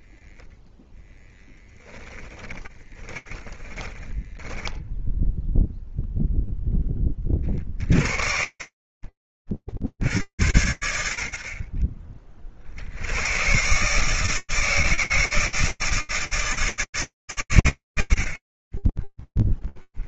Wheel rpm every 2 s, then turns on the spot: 10, 20, 10, 20, 30, 80, 90, 160, 150, 20.
2-6 18-20